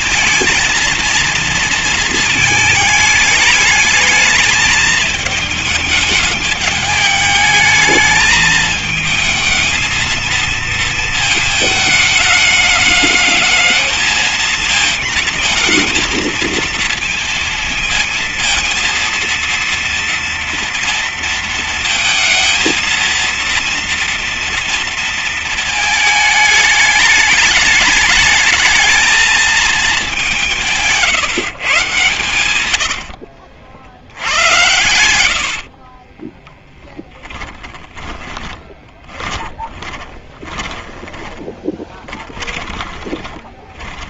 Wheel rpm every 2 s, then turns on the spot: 230, 210, 220, 210, 220, 230, 210, 220, 220, 230, 230, 220, 230, 210, 210, 170, 100, 100, 20, 20, 10, 20.
32-34 36-44